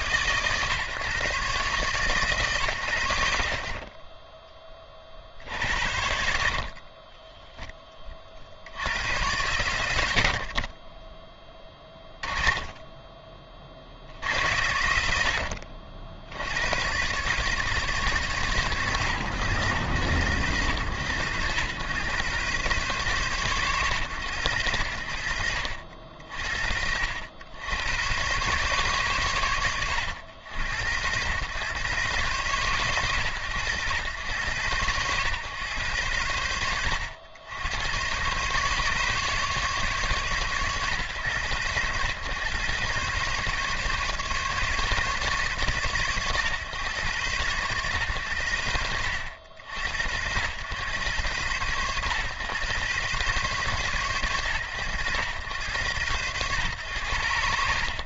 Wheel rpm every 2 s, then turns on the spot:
140, 110, 20, 60, 80, 10, 20, 70, 90, 110, 100, 120, 60, 70, 120, 100, 100, 100, 80, 140, 120, 130, 140, 130, 80, 100, 120, 110, 110.
10-12